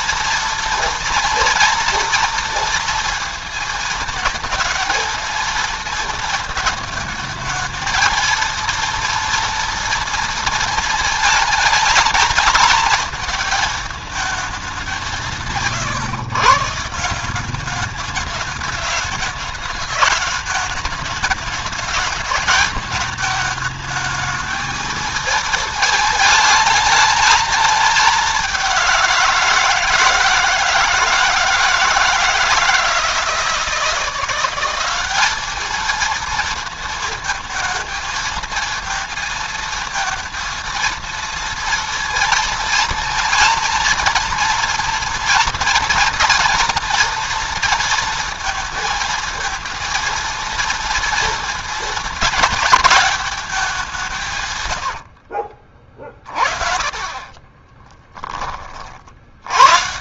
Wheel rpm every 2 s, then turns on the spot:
230, 230, 220, 220, 230, 220, 220, 190, 150, 210, 210, 220, 220, 220, 190, 160, 160, 190, 230, 220, 230, 230, 230, 240, 230, 230, 220, 110, 40, 40.
54-56